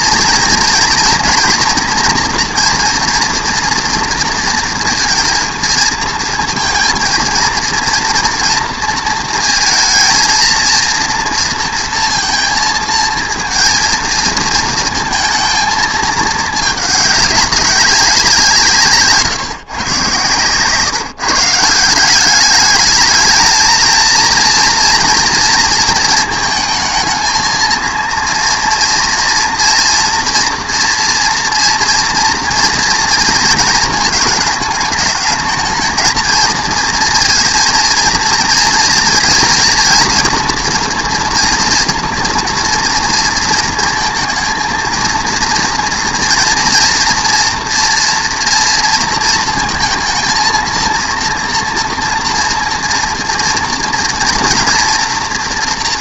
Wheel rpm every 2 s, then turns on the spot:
240, 240, 230, 230, 230, 230, 220, 220, 210, 170, 130, 210, 230, 220, 230, 230, 230, 210, 230, 230, 230, 230, 230, 230, 230, 230, 230, 230.
none